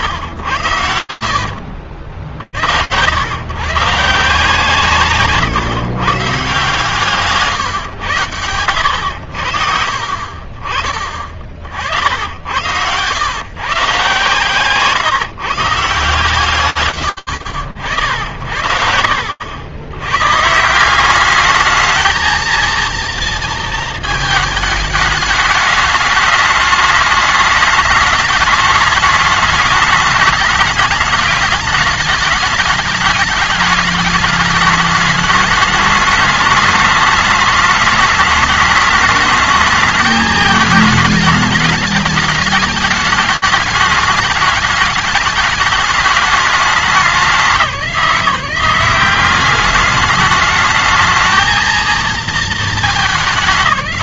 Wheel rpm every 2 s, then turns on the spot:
110, 80, 170, 160, 110, 40, 80, 160, 140, 80, 180, 230, 210, 210, 210, 210, 210, 210, 210, 210, 220, 210, 210, 200, 190, 220, 210.
none